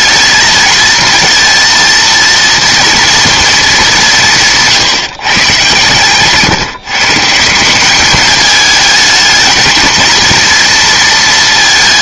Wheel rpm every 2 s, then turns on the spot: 220, 230, 160, 150, 210, 230.
none